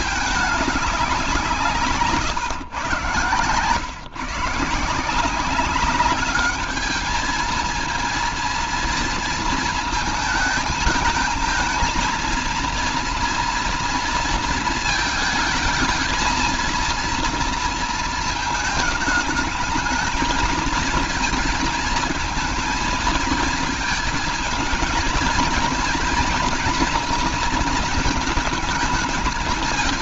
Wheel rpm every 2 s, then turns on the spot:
190, 120, 170, 220, 230, 220, 230, 220, 230, 220, 230, 220, 230, 240, 220.
none